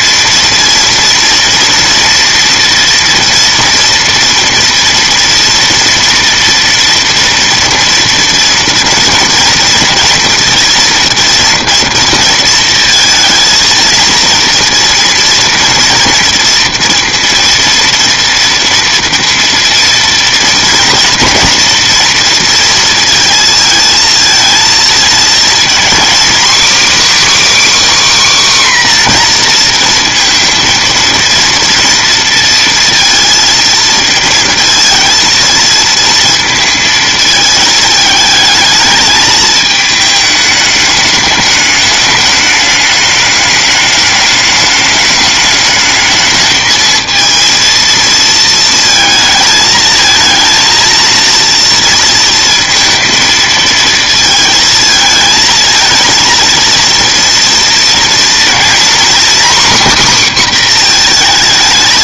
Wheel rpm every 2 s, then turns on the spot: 230, 230, 230, 230, 230, 230, 230, 230, 230, 230, 230, 230, 230, 270, 270, 220, 230, 230, 230, 220, 220, 210, 210, 220, 220, 230, 230, 220, 230, 240, 260.
none